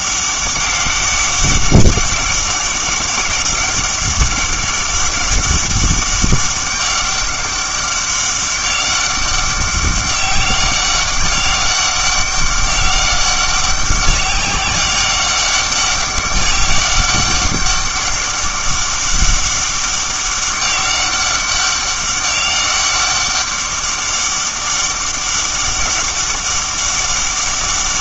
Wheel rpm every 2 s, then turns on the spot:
200, 200, 200, 200, 200, 200, 200, 190, 200, 200, 200, 200, 200, 200.
none